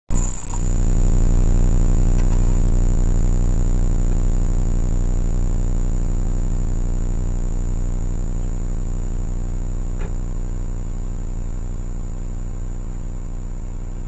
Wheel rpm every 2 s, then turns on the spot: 10, 0, 0, 0, 0, 0, 0.
none